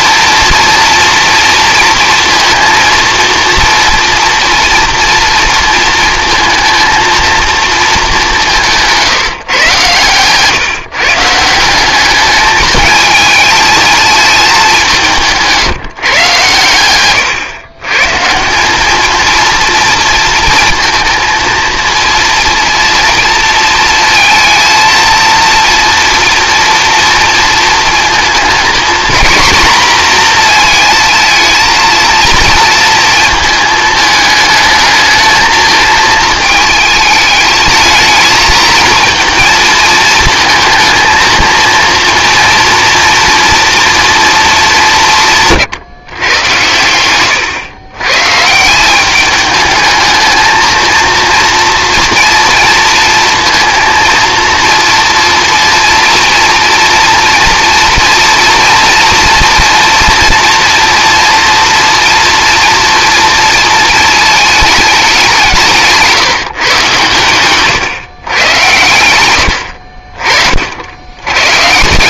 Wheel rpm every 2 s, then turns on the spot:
230, 230, 230, 220, 170, 150, 220, 190, 120, 190, 230, 230, 230, 230, 230, 230, 230, 220, 220, 220, 220, 240, 180, 90, 160, 220, 230, 230, 230, 230, 230, 230, 210, 140, 110, 60.
none